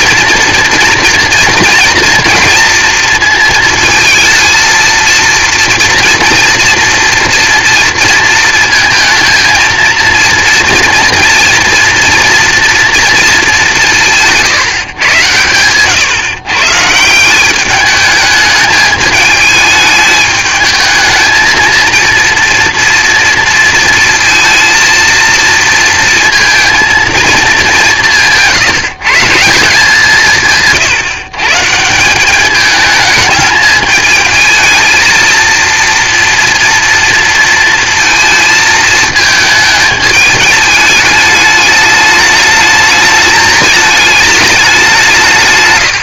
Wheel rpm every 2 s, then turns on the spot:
230, 230, 230, 230, 220, 230, 230, 150, 140, 210, 220, 230, 220, 230, 160, 150, 210, 220, 230, 220, 210, 210, 200.
none